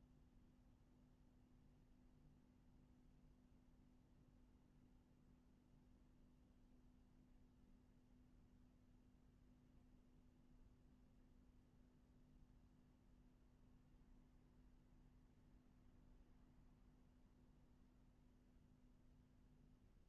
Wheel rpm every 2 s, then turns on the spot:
0, 0, 0, 0, 0, 0, 0, 0, 0, 0.
none